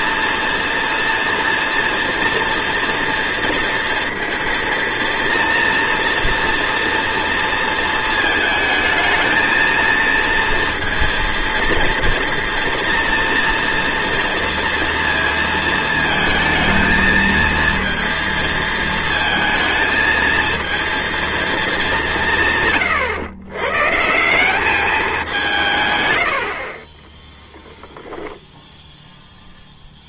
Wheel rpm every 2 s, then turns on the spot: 230, 230, 230, 230, 220, 230, 240, 240, 220, 230, 230, 150, 190, 60, 0.
none